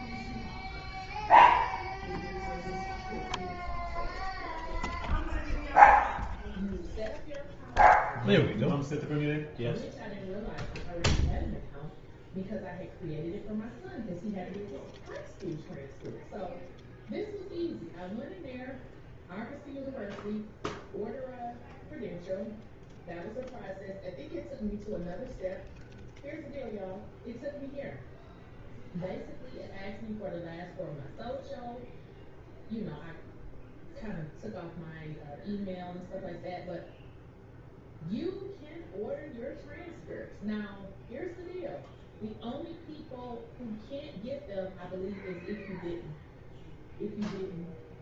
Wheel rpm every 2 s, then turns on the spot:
0, 0, 0, 0, 0, 0, 0, 0, 0, 0, 0, 0, 0, 0, 0, 0, 0, 0, 0, 0, 0, 0, 0, 0.
none